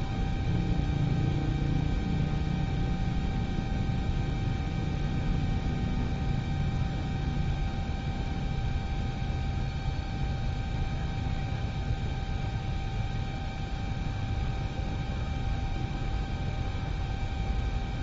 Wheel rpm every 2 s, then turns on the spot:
0, 0, 0, 0, 0, 0, 0, 0, 0.
none